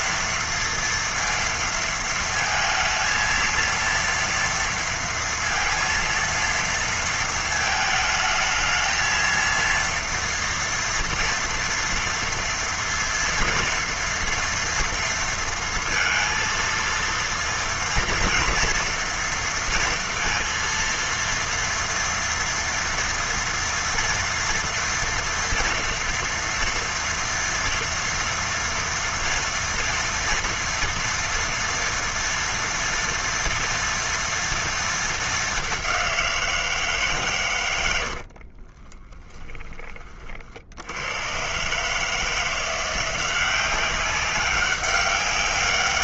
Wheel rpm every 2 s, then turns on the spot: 230, 230, 230, 230, 220, 230, 230, 230, 230, 230, 230, 230, 230, 230, 230, 230, 230, 230, 170, 50, 60, 170, 190.
38-40